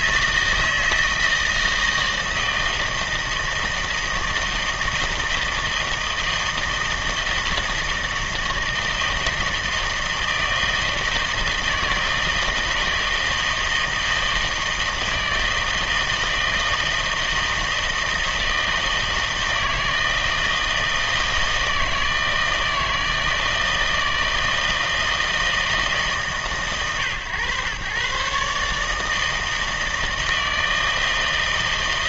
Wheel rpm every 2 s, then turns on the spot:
160, 160, 160, 160, 160, 160, 160, 160, 160, 160, 160, 160, 160, 130, 150, 160.
none